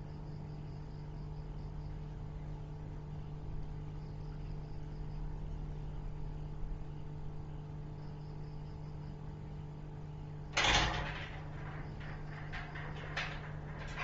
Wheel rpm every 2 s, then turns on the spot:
0, 0, 0, 0, 0, 0, 0.
none